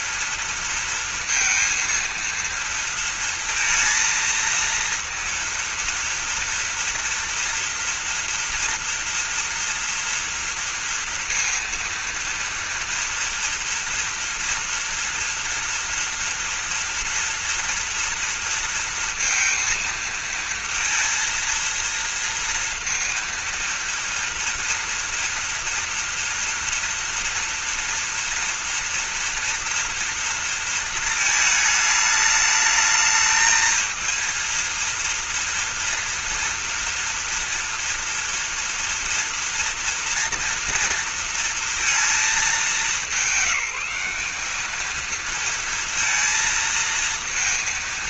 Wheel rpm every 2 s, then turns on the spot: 230, 230, 230, 230, 230, 230, 230, 240, 230, 230, 230, 230, 230, 230, 230, 230, 220, 230, 230, 240, 230, 200, 220, 230.
none